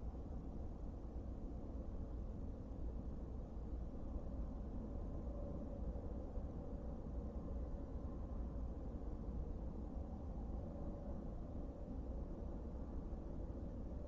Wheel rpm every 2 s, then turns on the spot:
0, 0, 0, 0, 0, 0, 0.
none